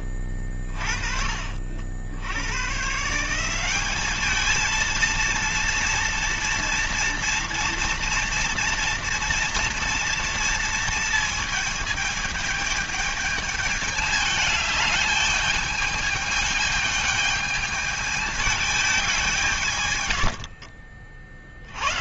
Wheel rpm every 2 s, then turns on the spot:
30, 110, 220, 230, 230, 230, 210, 210, 210, 210, 70.
20-22